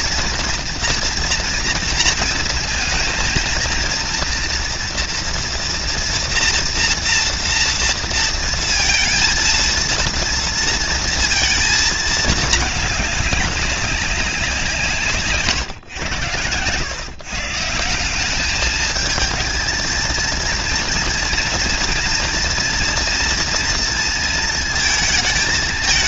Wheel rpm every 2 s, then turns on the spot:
240, 230, 240, 230, 230, 230, 210, 150, 150, 220, 230, 240, 220.
none